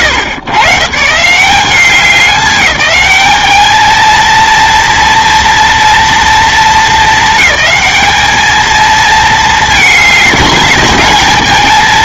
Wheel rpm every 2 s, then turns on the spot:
110, 200, 230, 210, 220, 210.
none